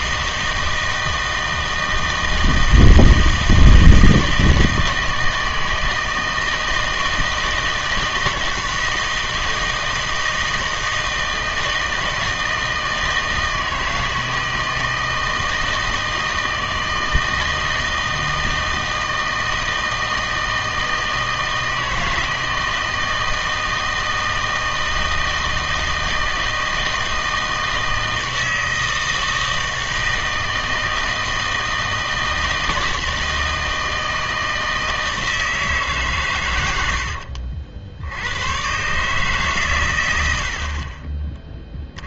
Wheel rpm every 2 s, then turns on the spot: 160, 160, 160, 160, 160, 160, 160, 160, 160, 160, 160, 160, 160, 160, 160, 160, 160, 160, 90, 120, 50.
none